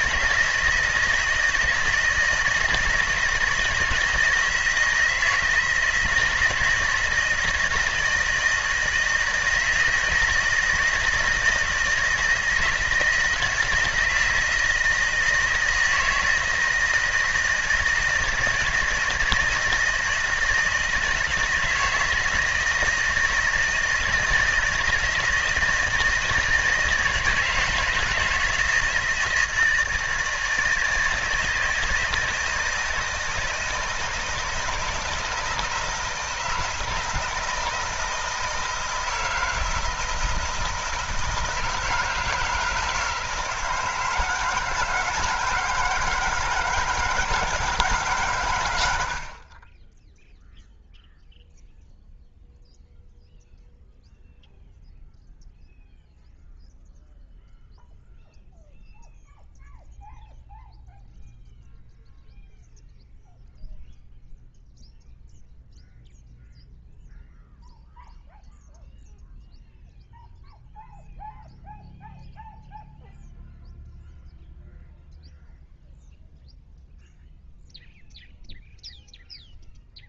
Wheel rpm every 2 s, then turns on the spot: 160, 160, 160, 160, 160, 160, 160, 160, 160, 160, 160, 160, 160, 160, 160, 160, 160, 160, 160, 160, 160, 160, 160, 170, 100, 0, 0, 0, 0, 0, 0, 0, 0, 0, 0, 0, 0, 0, 0, 0.
none